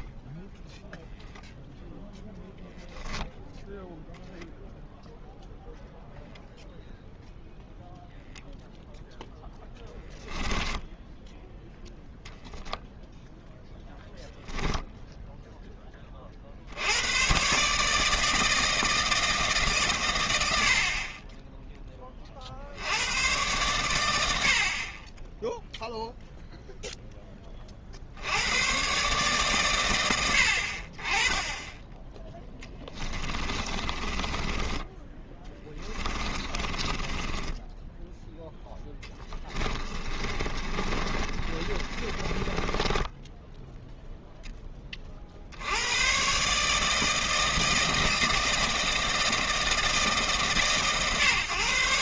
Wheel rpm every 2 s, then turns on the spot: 0, 0, 0, 0, 0, 0, 0, 0, 100, 160, 40, 90, 30, 10, 130, 20, 20, 20, 20, 10, 30, 20, 40, 160, 160, 110.
32-44